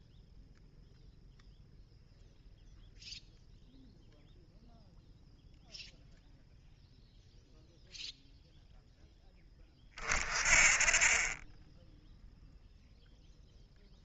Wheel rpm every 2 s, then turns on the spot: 0, 0, 0, 0, 0, 30, 0.
none